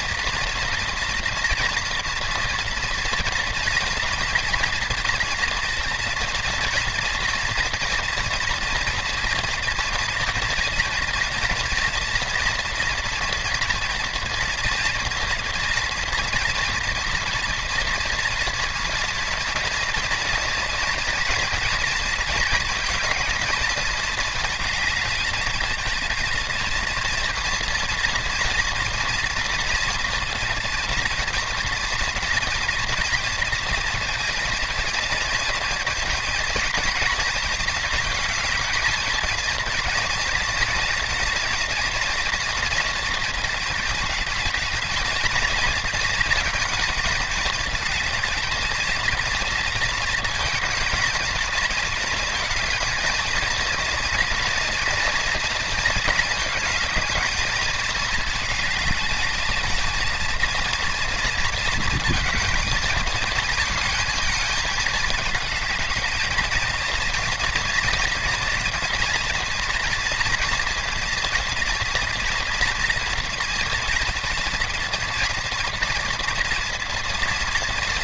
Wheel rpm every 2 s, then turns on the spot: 230, 230, 230, 230, 230, 230, 230, 230, 230, 230, 230, 230, 220, 230, 230, 230, 240, 220, 230, 220, 230, 230, 220, 220, 230, 230, 220, 230, 220, 220, 230, 230, 220, 230, 230, 230, 230, 230, 230.
none